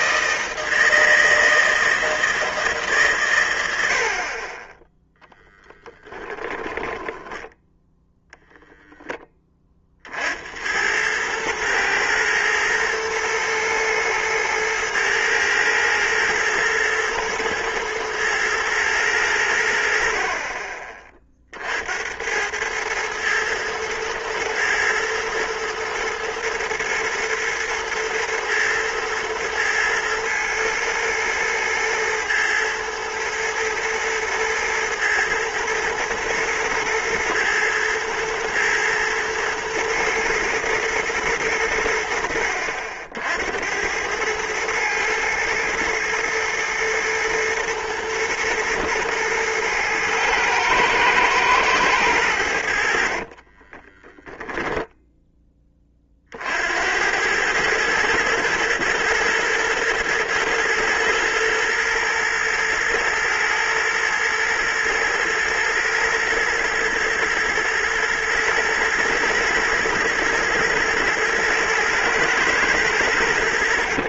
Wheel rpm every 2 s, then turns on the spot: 160, 160, 20, 20, 0, 70, 110, 110, 110, 110, 40, 100, 110, 110, 110, 120, 110, 110, 110, 120, 110, 70, 110, 110, 120, 110, 80, 10, 60, 110, 110, 110, 110, 110, 120, 110, 110.
6-8